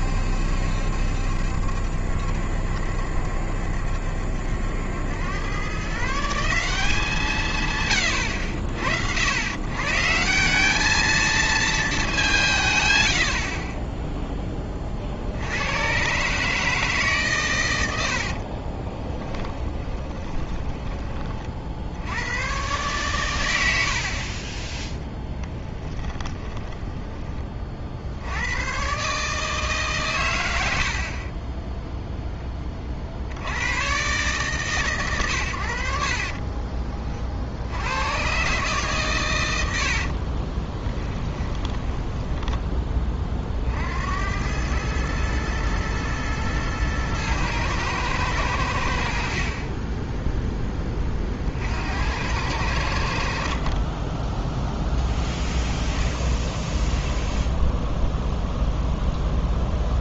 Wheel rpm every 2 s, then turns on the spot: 70, 70, 80, 180, 80, 190, 150, 20, 150, 30, 20, 120, 20, 20, 110, 90, 20, 130, 30, 120, 20, 10, 100, 110, 90, 10, 90, 0, 0, 0.
18-22 26-28 36-38 40-42